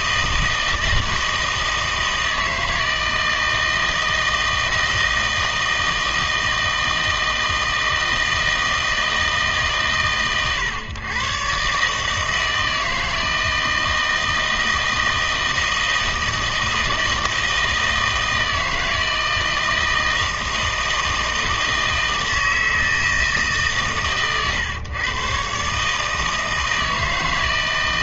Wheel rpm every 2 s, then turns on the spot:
160, 160, 160, 160, 160, 120, 160, 160, 160, 160, 160, 160, 130, 160.
none